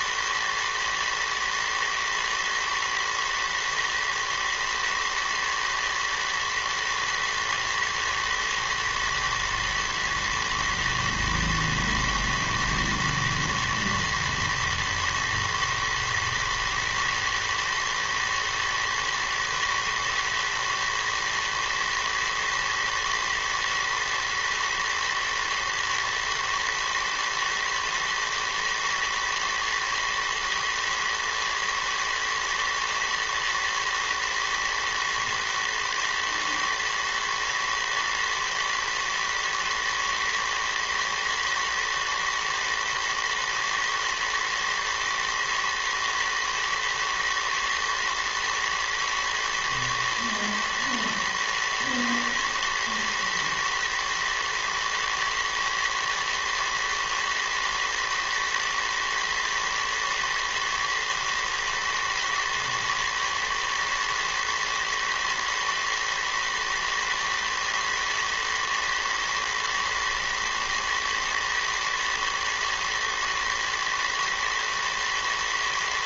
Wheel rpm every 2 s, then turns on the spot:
120, 110, 110, 110, 120, 110, 110, 120, 110, 110, 110, 110, 110, 110, 110, 110, 110, 110, 110, 110, 110, 110, 110, 120, 120, 110, 110, 110, 120, 110, 110, 110, 110, 110, 110, 110, 110, 110.
none